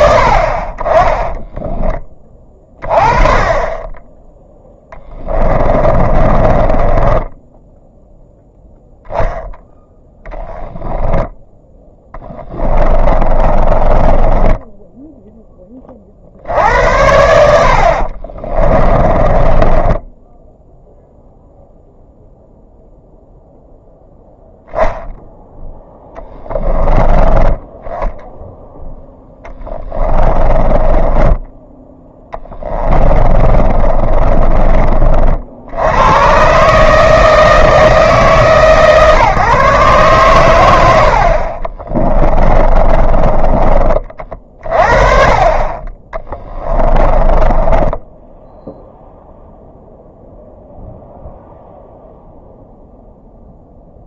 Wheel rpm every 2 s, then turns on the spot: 30, 30, 10, 10, 0, 20, 20, 10, 80, 20, 0, 0, 0, 10, 10, 20, 20, 40, 150, 130, 80, 20, 40, 20, 0, 0, 0.
4-8 10-16 18-20 30-34 42-44 46-48